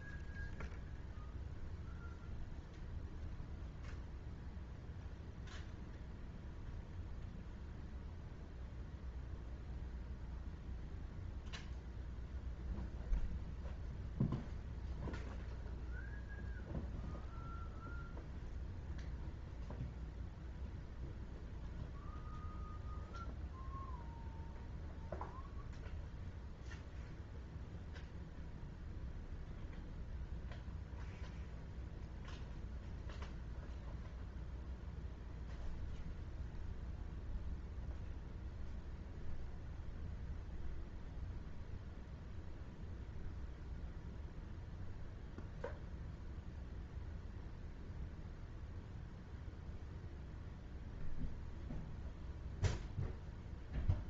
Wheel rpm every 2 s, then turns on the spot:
0, 0, 0, 0, 0, 0, 0, 0, 0, 0, 0, 0, 0, 0, 0, 0, 0, 0, 0, 0, 0, 0, 0, 0, 0, 0, 0.
none